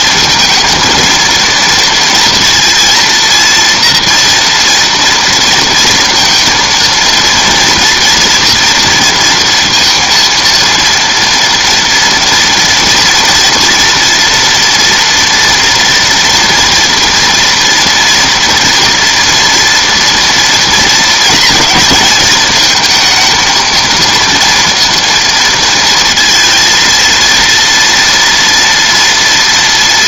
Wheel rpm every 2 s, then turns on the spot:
230, 230, 230, 230, 230, 230, 230, 230, 230, 230, 230, 220, 230, 230, 230.
none